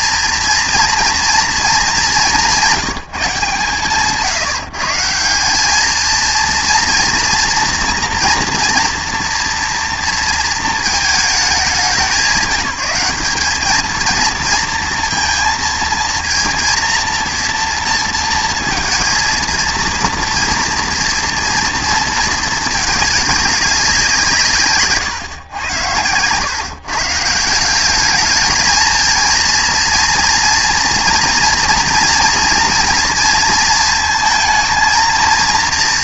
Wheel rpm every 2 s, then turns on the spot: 230, 190, 170, 230, 240, 230, 200, 230, 230, 230, 240, 220, 140, 140, 220, 230, 240, 230.
none